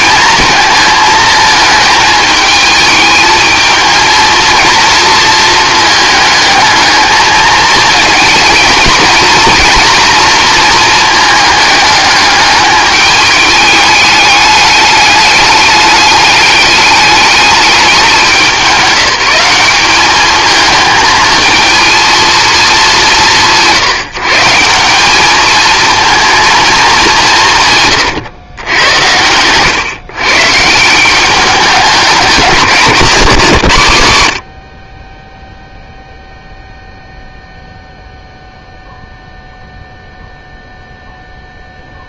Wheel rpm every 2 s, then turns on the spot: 220, 220, 230, 220, 220, 220, 210, 210, 210, 190, 220, 190, 190, 210, 90, 170, 190, 30, 0, 0, 0.
none